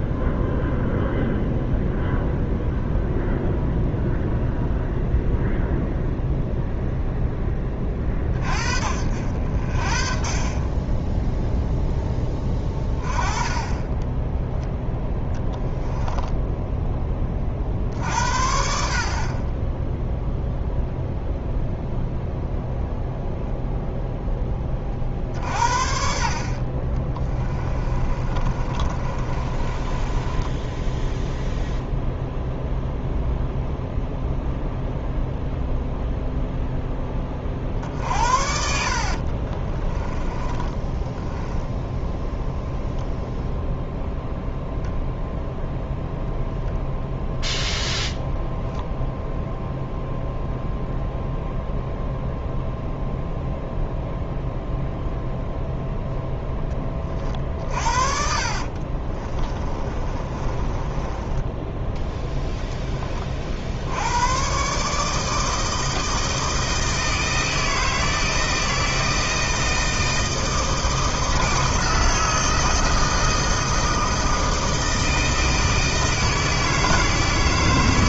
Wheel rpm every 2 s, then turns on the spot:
0, 0, 0, 0, 50, 20, 20, 10, 10, 60, 0, 0, 20, 40, 30, 10, 0, 0, 0, 60, 10, 0, 0, 0, 0, 0, 0, 0, 20, 50, 20, 10, 140, 160, 160, 160, 160, 160, 160.
28-32 38-42 58-62